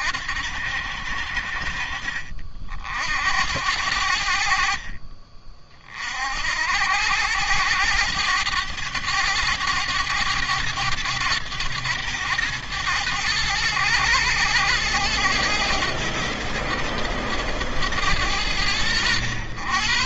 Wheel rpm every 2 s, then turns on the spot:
70, 60, 40, 80, 100, 110, 110, 110, 110, 100.
none